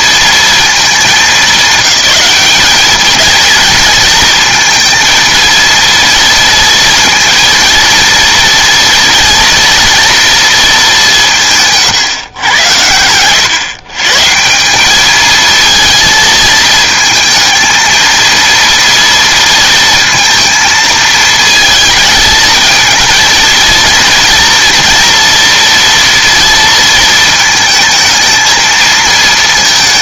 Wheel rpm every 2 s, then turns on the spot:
220, 200, 230, 230, 230, 210, 100, 180, 220, 230, 220, 220, 230, 230, 220.
none